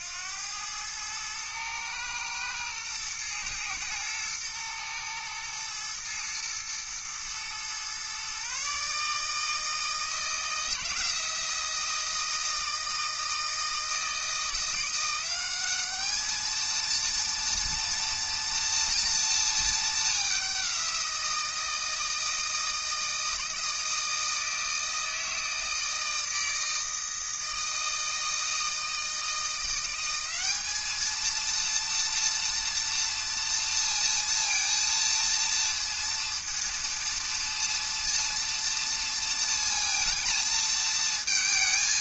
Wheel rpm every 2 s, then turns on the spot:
110, 120, 110, 120, 160, 170, 160, 200, 230, 220, 170, 160, 160, 160, 170, 220, 230, 230, 230, 230, 220.
none